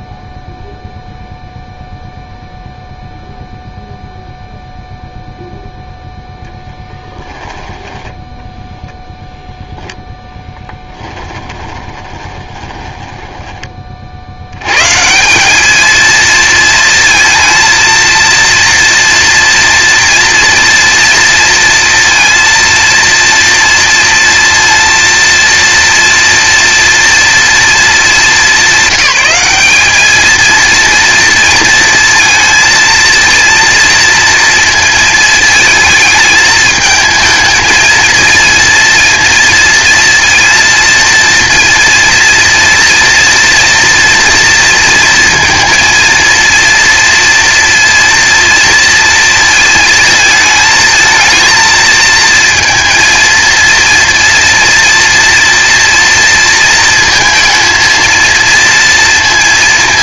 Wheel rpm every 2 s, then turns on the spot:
0, 0, 0, 0, 0, 10, 20, 90, 230, 230, 230, 230, 230, 230, 200, 230, 230, 230, 220, 230, 230, 230, 230, 230, 230, 220, 230, 230, 230, 230.
10-14